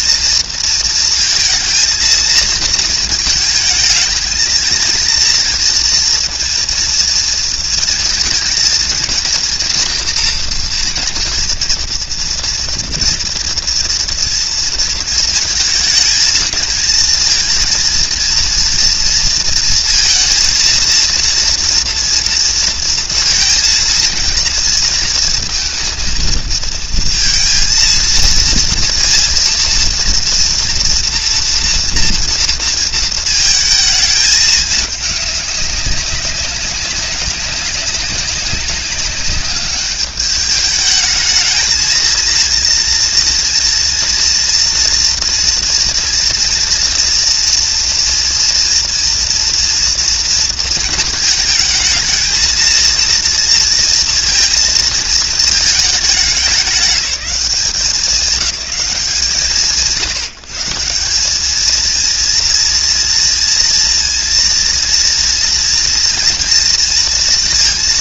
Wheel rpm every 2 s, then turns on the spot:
230, 230, 230, 230, 230, 230, 230, 230, 220, 230, 230, 230, 230, 230, 230, 230, 230, 210, 200, 190, 210, 230, 230, 230, 230, 230, 230, 230, 200, 190, 160, 230, 230, 230.
none